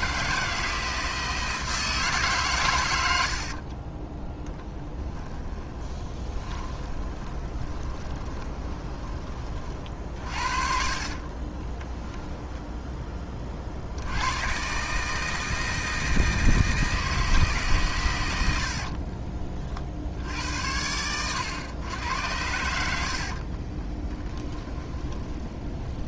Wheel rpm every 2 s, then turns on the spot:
160, 110, 10, 20, 20, 50, 10, 140, 160, 60, 90, 70, 20.
4-12 18-20 24-26